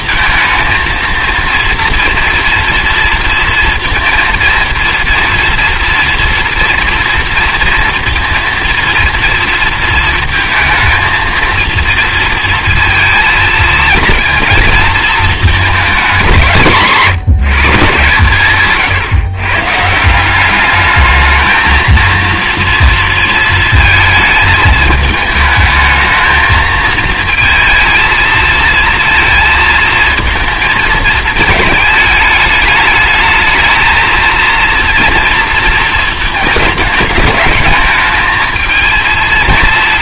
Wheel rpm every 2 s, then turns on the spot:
220, 240, 230, 230, 230, 220, 230, 230, 180, 140, 200, 230, 220, 220, 230, 230, 210, 230, 210, 220.
none